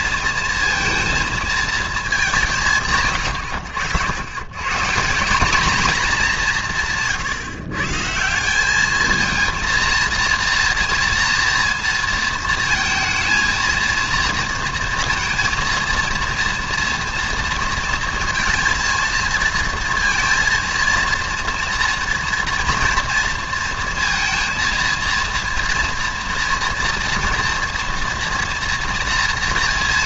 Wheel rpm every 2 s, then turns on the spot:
230, 160, 140, 180, 200, 230, 220, 230, 230, 230, 230, 230, 230, 230, 230.
none